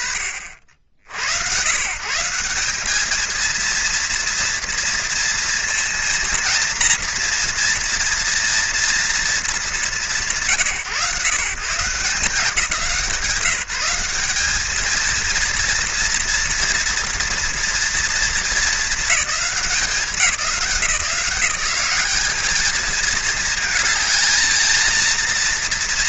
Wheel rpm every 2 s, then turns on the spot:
90, 220, 230, 230, 230, 160, 170, 230, 230, 210, 160, 220, 230.
none